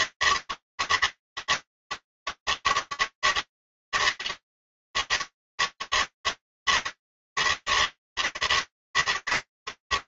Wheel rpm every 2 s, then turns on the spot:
160, 160, 160, 160, 150.
none